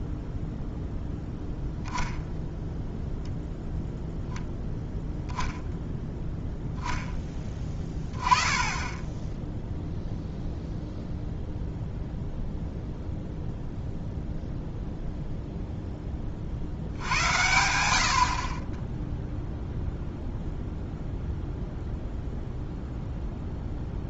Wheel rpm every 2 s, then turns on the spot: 0, 0, 0, 0, 10, 0, 0, 0, 60, 30, 0, 0.
none